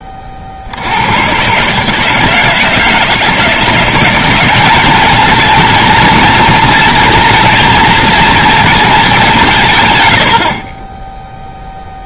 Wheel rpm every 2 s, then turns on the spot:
90, 160, 220, 240, 210, 20.
none